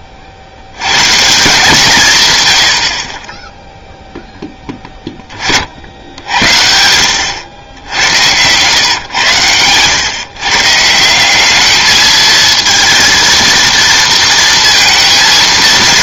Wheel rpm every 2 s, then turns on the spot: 60, 90, 10, 70, 110, 150, 230, 230.
none